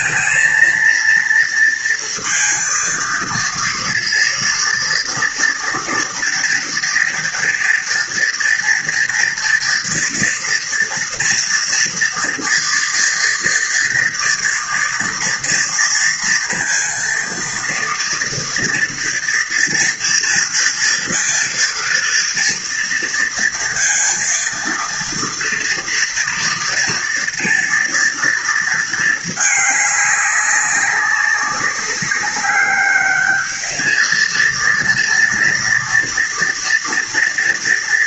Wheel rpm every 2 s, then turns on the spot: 230, 230, 230, 230, 240, 240, 230, 230, 230, 230, 230, 230, 230, 230, 230, 200, 200, 230, 230.
none